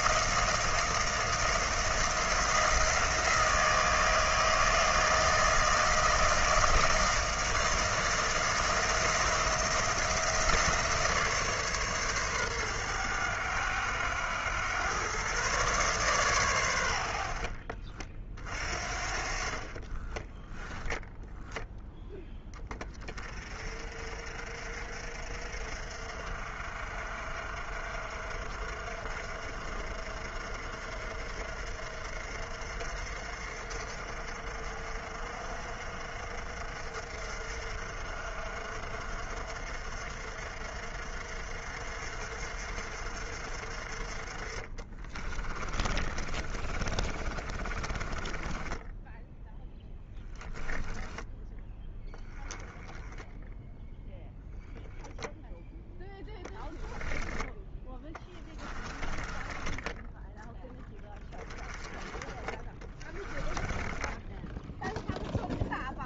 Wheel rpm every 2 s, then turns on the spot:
160, 160, 160, 160, 170, 160, 100, 120, 90, 40, 10, 30, 50, 50, 50, 50, 50, 50, 50, 60, 50, 50, 30, 40, 10, 10, 10, 10, 0, 20, 10, 20, 0.
44-52 58-60 62-64